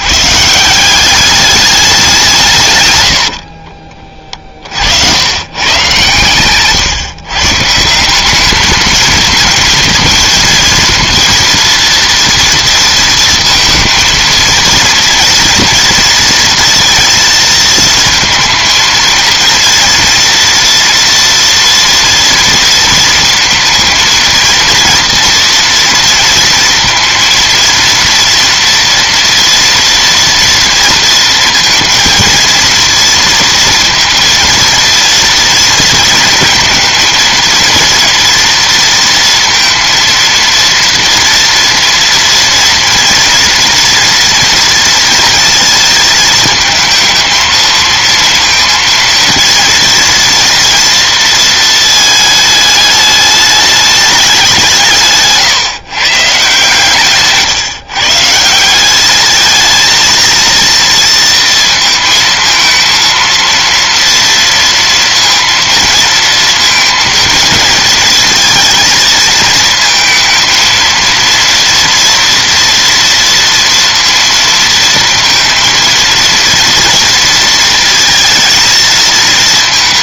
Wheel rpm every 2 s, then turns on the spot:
200, 90, 90, 140, 220, 230, 230, 230, 220, 230, 230, 230, 230, 230, 230, 230, 230, 230, 230, 230, 230, 230, 230, 220, 230, 230, 210, 150, 140, 190, 230, 230, 230, 230, 220, 230, 230, 230, 230, 230.
none